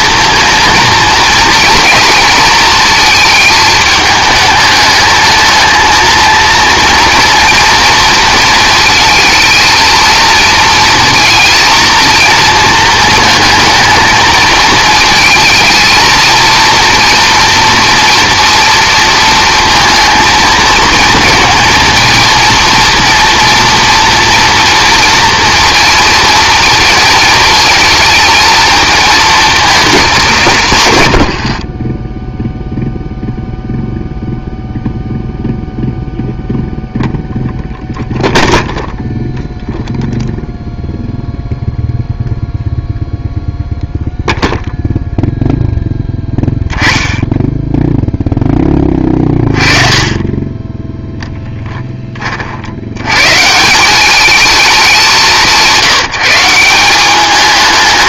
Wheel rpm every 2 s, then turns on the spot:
230, 230, 210, 230, 230, 230, 230, 220, 240, 230, 220, 230, 240, 230, 220, 130, 0, 0, 0, 0, 0, 0, 0, 10, 20, 10, 70, 200, 190.
none